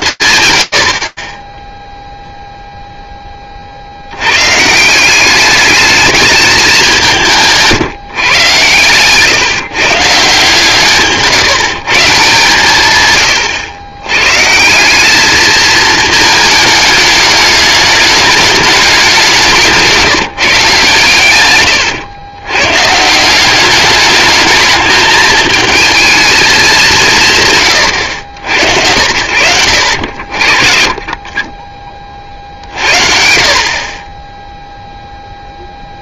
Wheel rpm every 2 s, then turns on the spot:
130, 0, 150, 210, 130, 150, 120, 160, 210, 210, 140, 130, 220, 190, 80, 40, 50, 0.
none